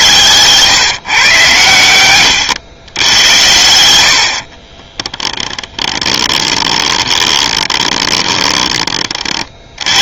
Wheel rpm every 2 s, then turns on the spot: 140, 100, 20, 20, 30.
4-8